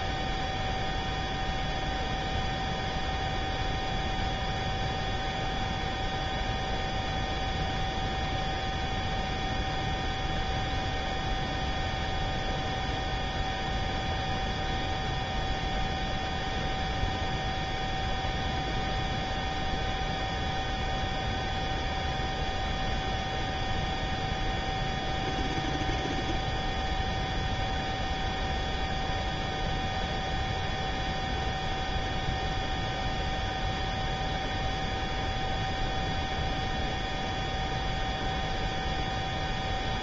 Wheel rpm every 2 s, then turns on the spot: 0, 0, 0, 0, 0, 0, 0, 0, 0, 0, 0, 0, 0, 0, 0, 0, 0, 0, 0, 0.
none